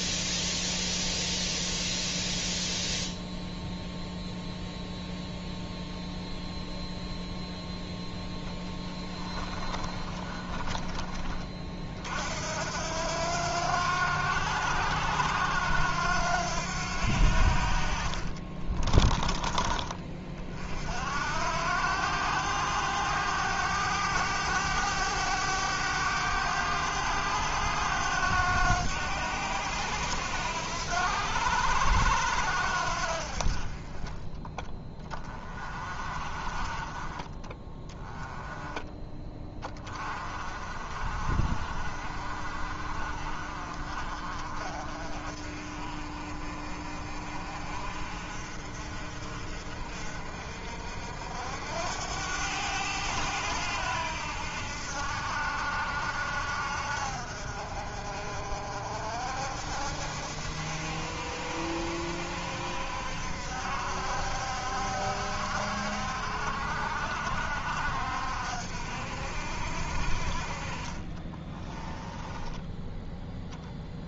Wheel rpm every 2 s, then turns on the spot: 0, 0, 0, 0, 10, 30, 80, 90, 80, 20, 60, 100, 100, 100, 90, 80, 70, 20, 20, 10, 40, 40, 40, 40, 50, 60, 100, 70, 70, 60, 70, 60, 70, 60, 60, 30, 10.
8-10 18-20 70-72